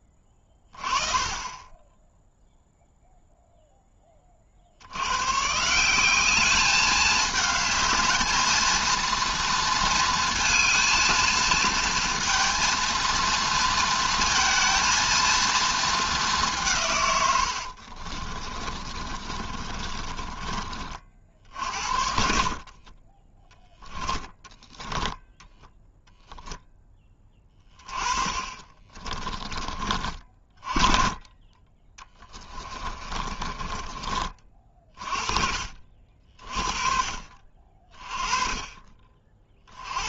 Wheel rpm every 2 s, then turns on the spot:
30, 0, 80, 210, 230, 230, 230, 230, 140, 30, 40, 20, 10, 20, 30, 20, 20, 30, 30, 30.
18-20 22-26 28-30 32-34